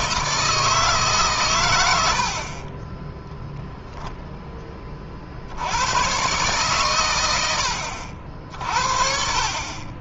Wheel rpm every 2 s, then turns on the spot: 160, 40, 20, 130, 50.
none